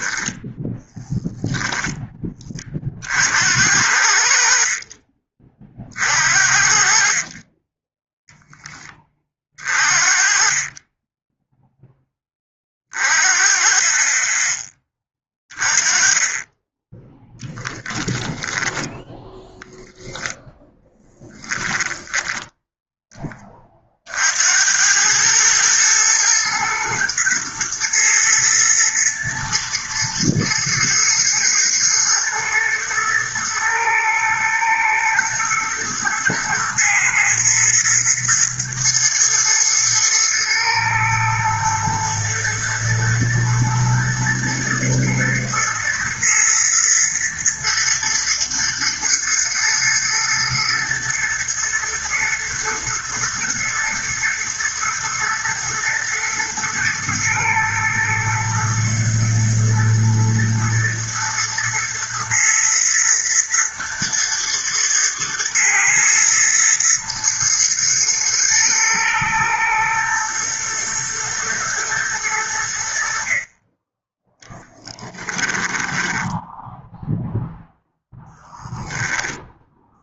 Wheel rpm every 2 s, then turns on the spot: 10, 50, 30, 40, 20, 20, 40, 20, 10, 10, 10, 10, 100, 120, 110, 120, 120, 120, 110, 120, 120, 110, 120, 110, 110, 110, 110, 120, 120, 110, 120, 120, 110, 120, 110, 110, 60, 10, 0, 0.
18-22 74-76